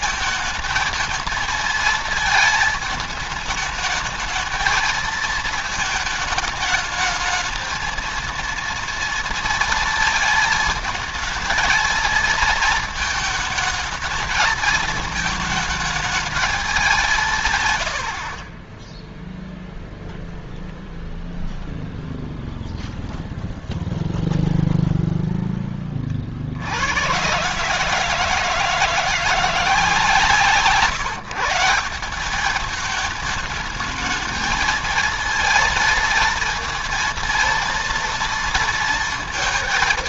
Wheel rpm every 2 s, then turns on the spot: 220, 220, 220, 220, 230, 220, 220, 220, 190, 10, 0, 0, 0, 90, 170, 140, 210, 230, 230, 230.
18-20